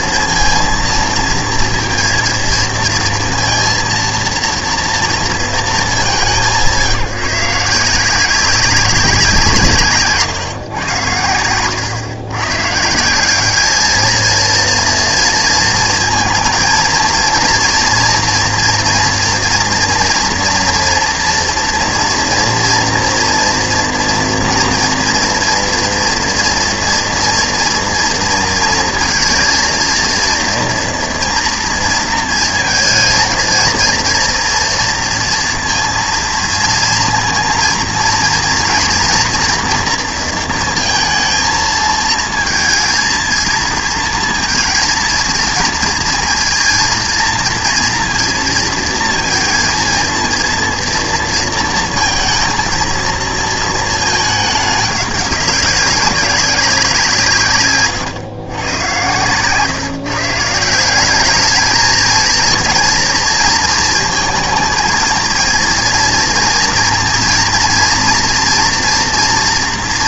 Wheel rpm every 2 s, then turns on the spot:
230, 230, 230, 180, 190, 130, 130, 230, 220, 240, 240, 230, 230, 230, 230, 230, 220, 230, 230, 230, 230, 230, 230, 230, 230, 230, 230, 210, 200, 120, 160, 230, 230, 240, 230.
none